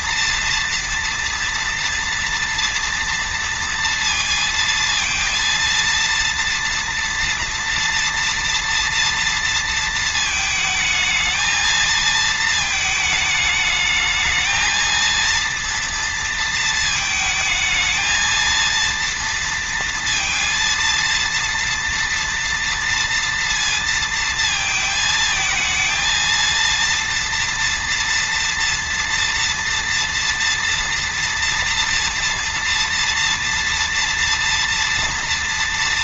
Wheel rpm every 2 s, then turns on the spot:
230, 230, 230, 230, 230, 220, 220, 230, 220, 230, 230, 230, 220, 230, 230, 230, 230, 240.
none